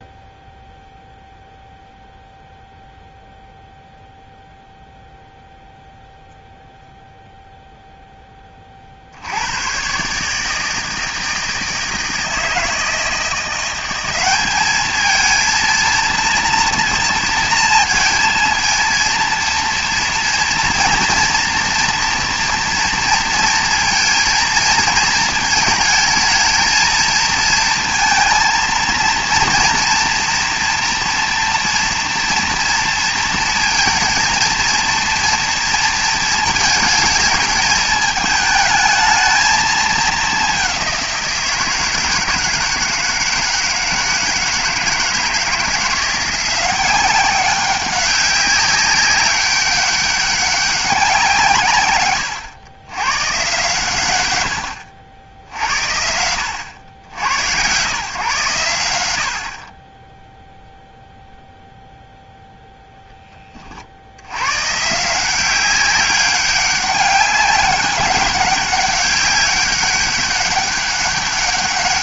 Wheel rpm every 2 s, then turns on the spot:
0, 0, 0, 0, 40, 160, 160, 210, 230, 230, 230, 230, 220, 220, 230, 230, 230, 230, 220, 220, 190, 160, 160, 180, 200, 190, 100, 80, 80, 100, 0, 10, 140, 200, 200, 200.
none